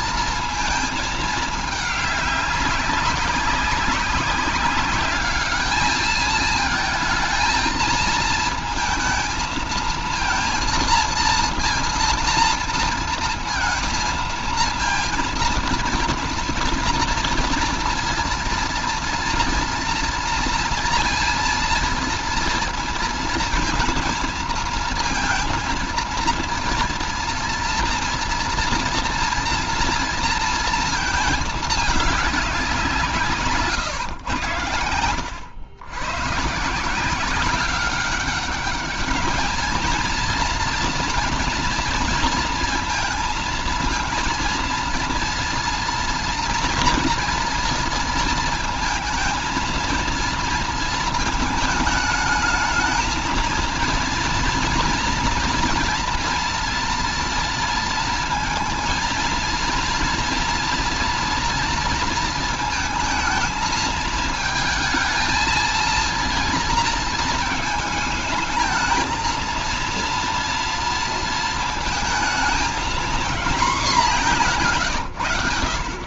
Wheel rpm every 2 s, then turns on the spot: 220, 200, 200, 220, 220, 220, 230, 230, 240, 230, 230, 230, 230, 230, 240, 220, 180, 80, 160, 200, 230, 230, 230, 230, 230, 230, 220, 240, 230, 230, 230, 220, 220, 230, 220, 230, 220, 160.
34-36